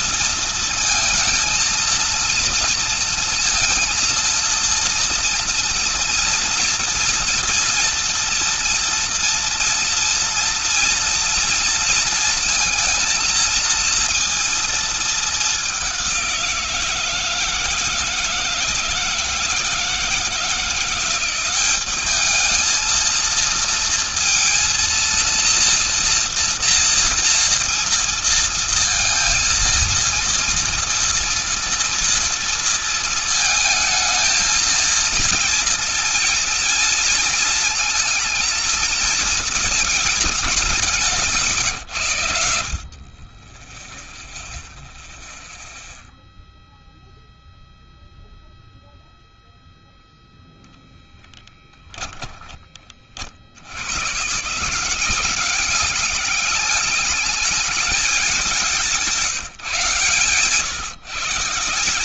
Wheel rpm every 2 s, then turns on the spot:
230, 230, 230, 230, 240, 230, 230, 230, 180, 160, 170, 210, 230, 240, 230, 230, 230, 220, 230, 220, 200, 70, 0, 0, 0, 0, 10, 130, 200, 200, 140.
none